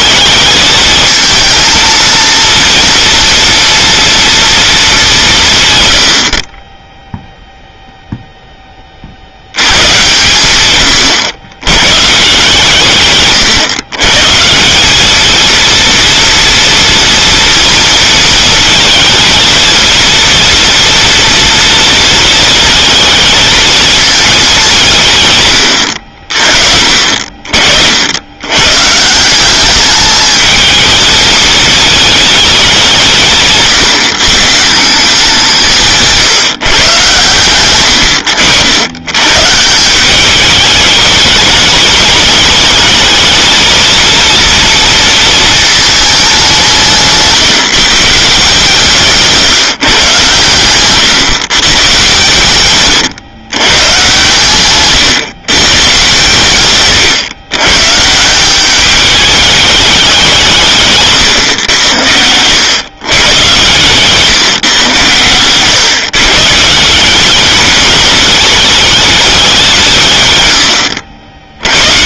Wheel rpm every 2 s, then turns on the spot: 220, 230, 160, 10, 80, 100, 130, 220, 230, 230, 230, 220, 130, 40, 160, 220, 180, 180, 120, 120, 200, 220, 230, 160, 160, 130, 120, 130, 120, 210, 140, 120, 120, 170, 210, 80.
46-48